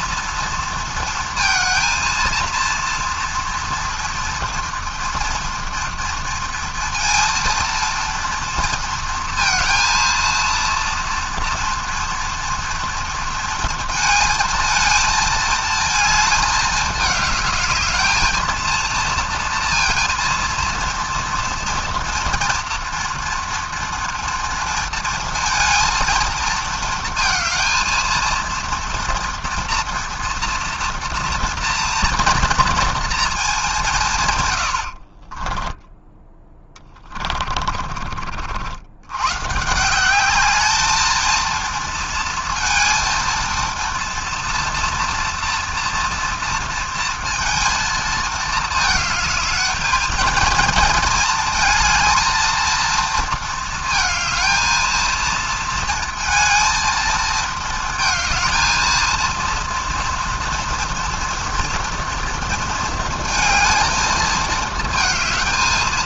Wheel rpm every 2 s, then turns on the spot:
230, 230, 230, 230, 230, 230, 230, 230, 220, 230, 230, 230, 230, 230, 230, 230, 230, 110, 10, 70, 210, 230, 240, 230, 220, 230, 230, 220, 230, 230, 230, 230, 220.
34-36